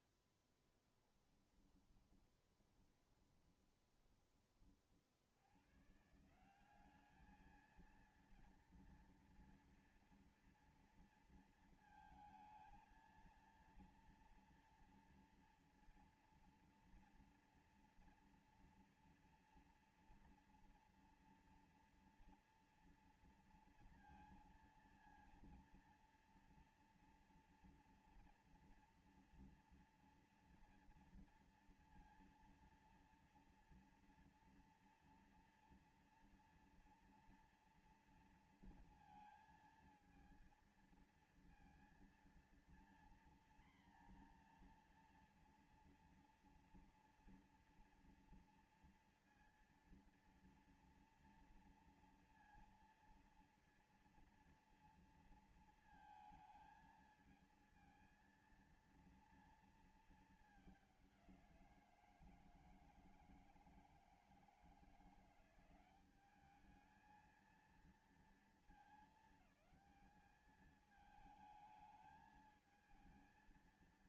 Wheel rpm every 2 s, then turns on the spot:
30, 20, 40, 180, 230, 230, 230, 230, 230, 230, 230, 240, 230, 230, 230, 230, 230, 240, 230, 230, 230, 230, 240, 230, 230, 230, 230, 230, 220, 230, 210, 160, 160, 210, 220, 210, 220.
0-4